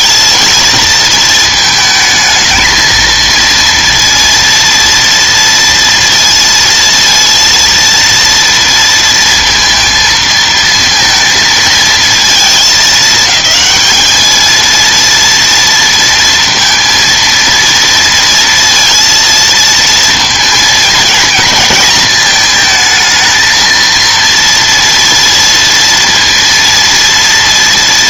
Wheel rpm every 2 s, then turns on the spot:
230, 220, 230, 230, 230, 230, 220, 220, 230, 230, 220, 220, 230, 230.
none